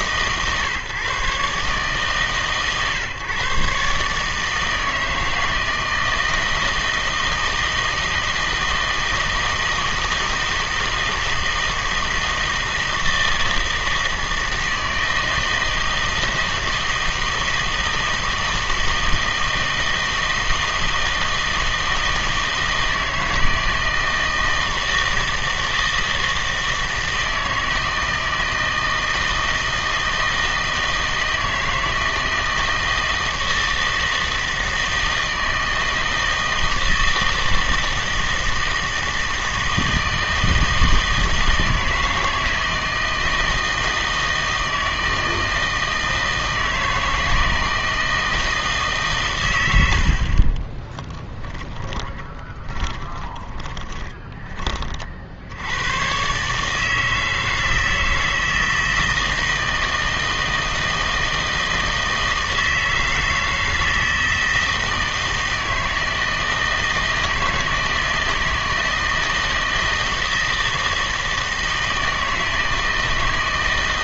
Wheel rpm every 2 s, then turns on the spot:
140, 130, 160, 160, 160, 160, 160, 160, 160, 160, 160, 160, 160, 160, 160, 160, 160, 160, 160, 160, 160, 160, 160, 160, 160, 20, 20, 30, 150, 160, 160, 160, 160, 160, 160, 160, 160.
50-54